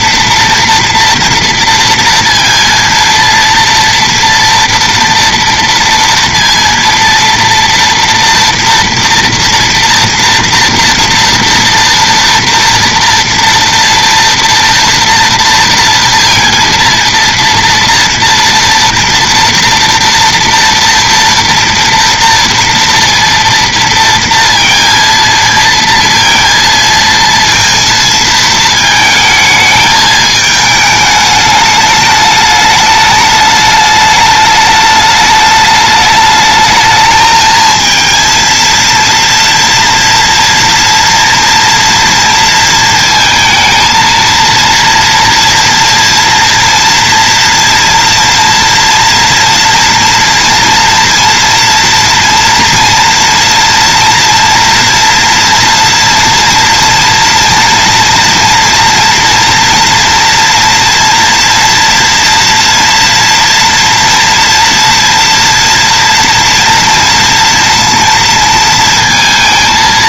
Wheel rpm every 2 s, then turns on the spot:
230, 230, 230, 230, 230, 230, 230, 230, 230, 230, 230, 230, 230, 230, 220, 210, 210, 210, 210, 230, 230, 230, 230, 230, 230, 230, 230, 230, 230, 240, 230, 230, 230, 230, 230.
none